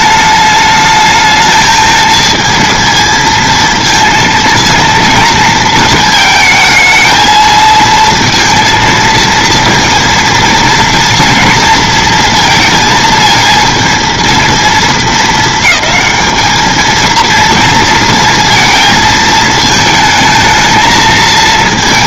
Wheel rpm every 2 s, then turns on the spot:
220, 230, 230, 220, 230, 230, 220, 220, 230, 220, 220.
none